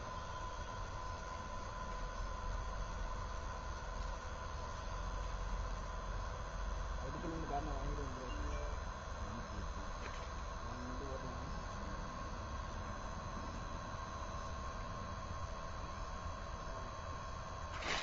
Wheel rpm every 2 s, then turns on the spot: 0, 0, 0, 0, 0, 0, 0, 0, 0.
none